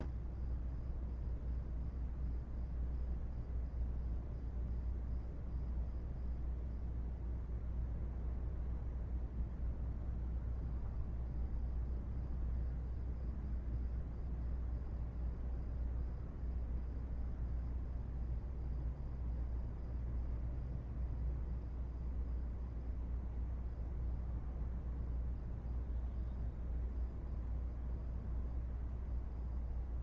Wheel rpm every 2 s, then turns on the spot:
0, 0, 0, 0, 0, 0, 0, 0, 0, 0, 0, 0, 0, 0, 0.
none